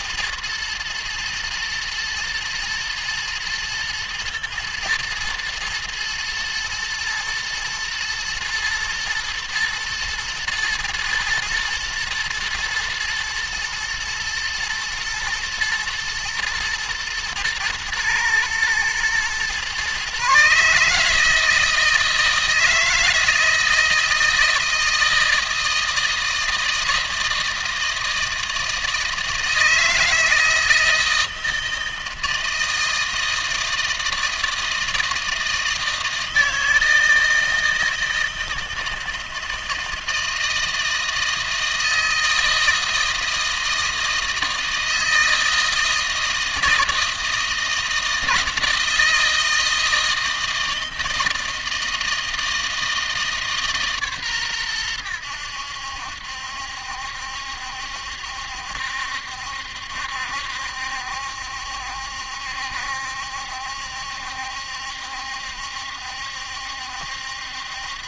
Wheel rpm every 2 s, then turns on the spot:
120, 120, 110, 110, 120, 110, 120, 120, 120, 110, 140, 160, 160, 160, 160, 160, 160, 160, 160, 160, 160, 160, 160, 160, 160, 160, 160, 110, 70, 70, 70, 70, 70, 70.
none